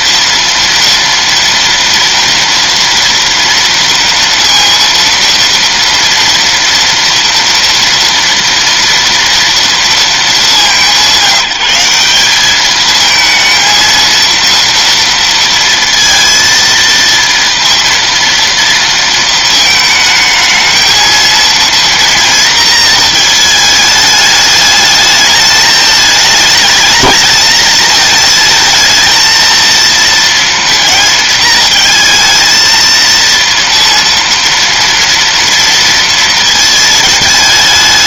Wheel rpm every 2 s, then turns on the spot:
230, 230, 230, 230, 230, 180, 210, 230, 230, 230, 220, 230, 210, 210, 220, 230, 230, 230, 230.
none